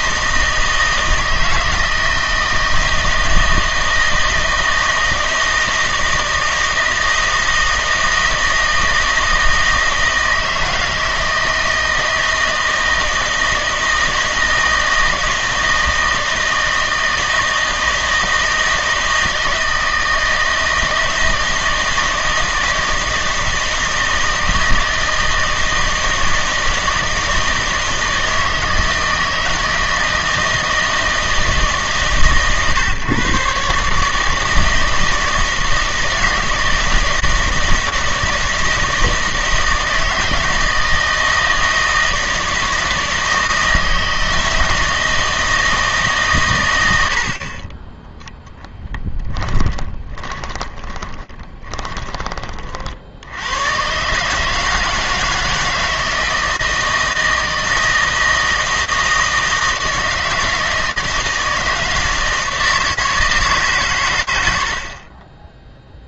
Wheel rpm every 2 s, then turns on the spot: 160, 160, 160, 160, 160, 160, 160, 160, 160, 160, 160, 160, 160, 160, 160, 160, 130, 160, 160, 160, 160, 160, 160, 100, 10, 20, 40, 160, 160, 160, 160, 160, 70.
48-52